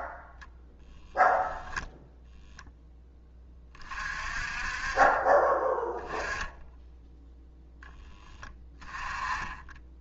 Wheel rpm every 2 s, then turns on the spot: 0, 0, 30, 10, 10.
8-10